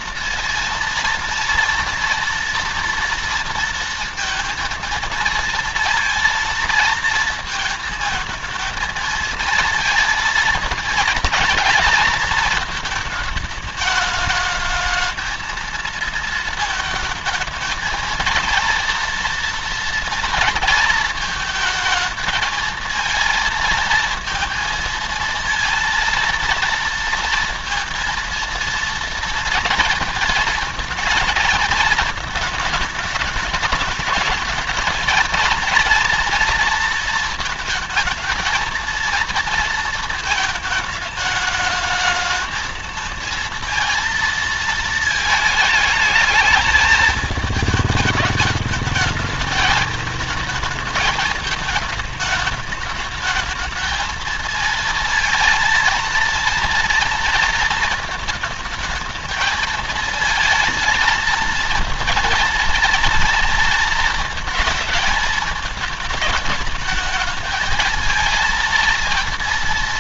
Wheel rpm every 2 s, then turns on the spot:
230, 230, 230, 230, 220, 230, 220, 210, 220, 230, 230, 220, 230, 230, 230, 230, 220, 220, 230, 230, 220, 220, 230, 220, 210, 220, 210, 220, 230, 220, 230, 230, 220, 210, 230.
none